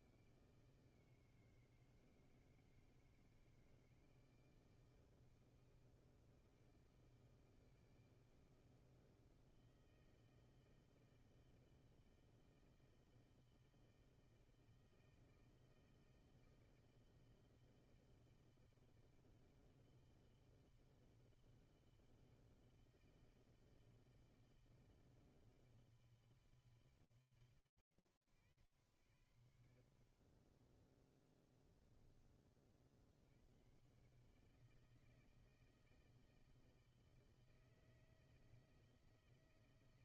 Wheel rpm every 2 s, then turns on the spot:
160, 160, 160, 160, 160, 160, 160, 160, 160, 160, 160, 160, 160, 140, 90, 20, 40, 160, 160, 160.
none